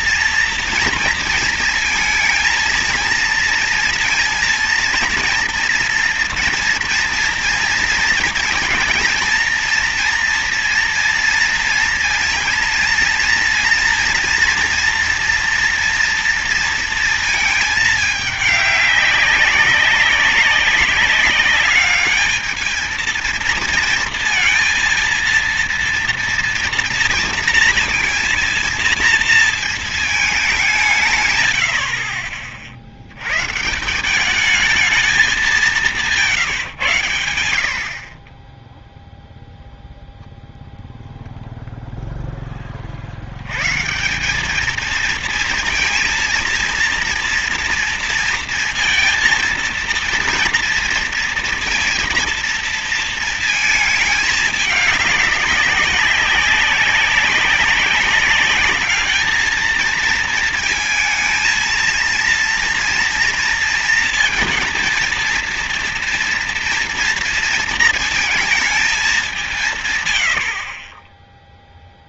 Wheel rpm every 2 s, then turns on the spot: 230, 220, 230, 230, 230, 230, 230, 230, 230, 200, 190, 220, 230, 240, 230, 190, 50, 210, 130, 10, 0, 20, 210, 230, 230, 230, 230, 210, 190, 200, 230, 230, 230, 230, 220, 60.
none